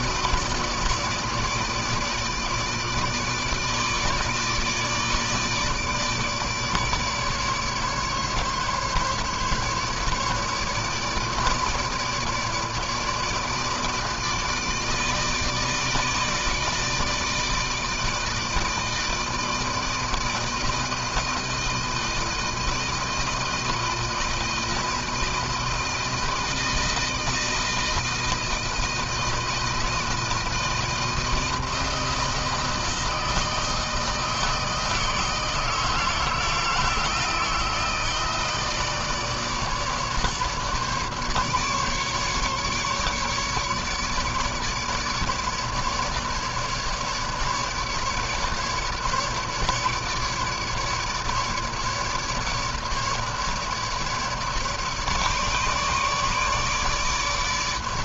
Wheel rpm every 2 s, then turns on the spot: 160, 150, 150, 150, 150, 150, 150, 160, 160, 160, 160, 160, 160, 160, 160, 160, 160, 160, 160, 160, 150, 150, 150, 150, 150, 150, 150, 150, 150.
none